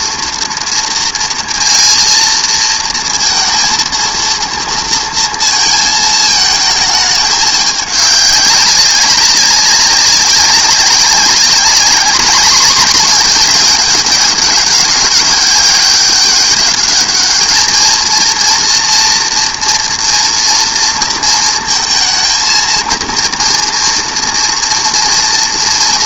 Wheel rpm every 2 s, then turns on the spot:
230, 230, 230, 220, 200, 190, 210, 200, 200, 230, 230, 230, 230.
none